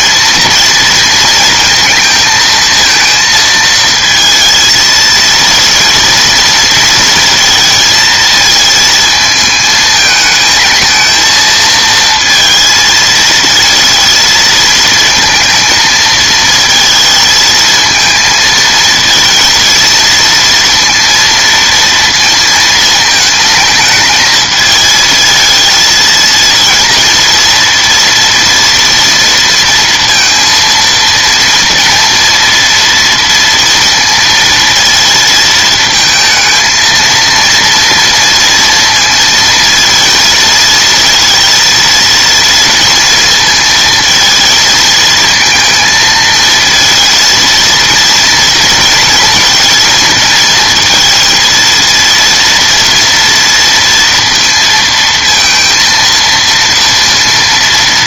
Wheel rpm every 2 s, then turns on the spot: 230, 220, 220, 230, 220, 220, 230, 220, 230, 230, 230, 220, 220, 230, 240, 230, 230, 230, 220, 230, 230, 230, 230, 220, 230, 230, 240, 230, 230.
none